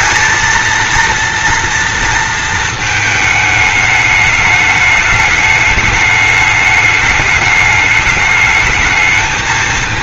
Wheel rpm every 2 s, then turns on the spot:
230, 220, 210, 210, 220.
none